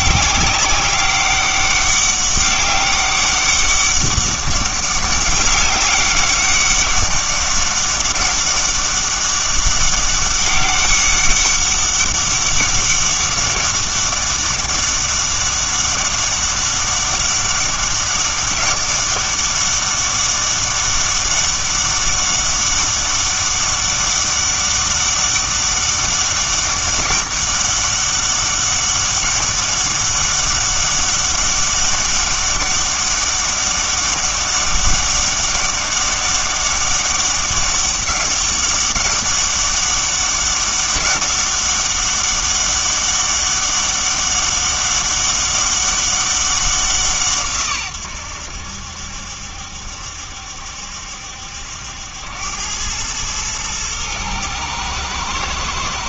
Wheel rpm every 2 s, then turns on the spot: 200, 200, 200, 200, 200, 200, 200, 200, 200, 200, 200, 200, 200, 200, 200, 200, 200, 200, 200, 200, 200, 200, 200, 190, 80, 70, 100, 110.
none